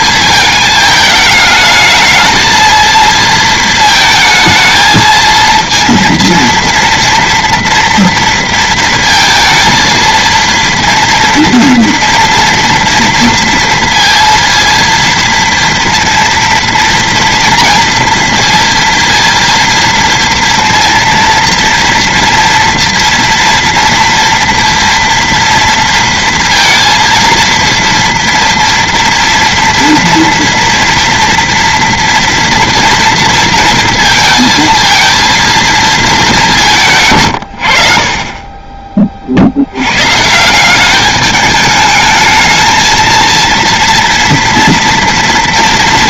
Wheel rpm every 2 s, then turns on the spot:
220, 220, 220, 230, 230, 230, 230, 230, 240, 230, 230, 230, 230, 230, 240, 230, 230, 220, 180, 20, 170, 220, 230.
none